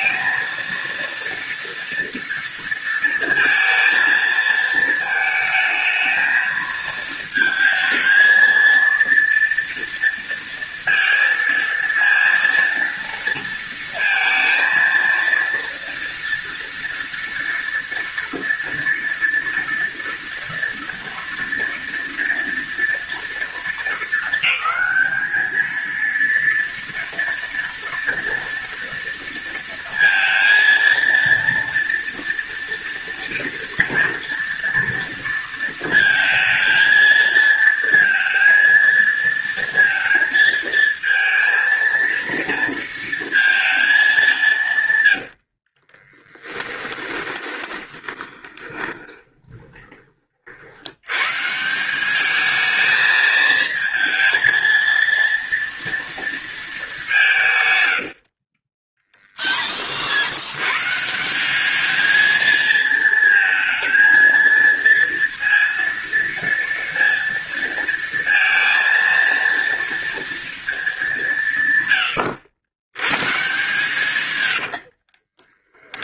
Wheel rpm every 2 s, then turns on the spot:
230, 230, 220, 220, 230, 230, 230, 230, 230, 230, 240, 230, 210, 230, 230, 230, 240, 230, 230, 230, 230, 230, 150, 20, 20, 80, 220, 230, 210, 20, 120, 230, 230, 230, 230, 210, 110, 70.
44-50 74-76